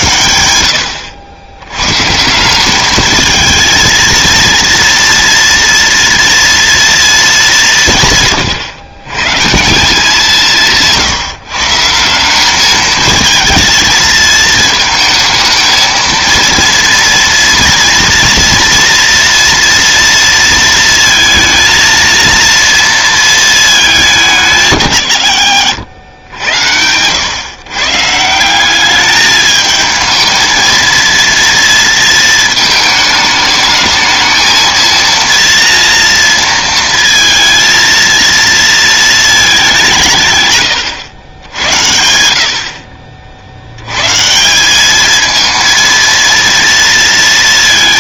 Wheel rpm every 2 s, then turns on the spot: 90, 210, 230, 230, 120, 160, 220, 220, 230, 230, 230, 230, 140, 100, 200, 230, 220, 230, 230, 230, 110, 50, 210, 230.
10-12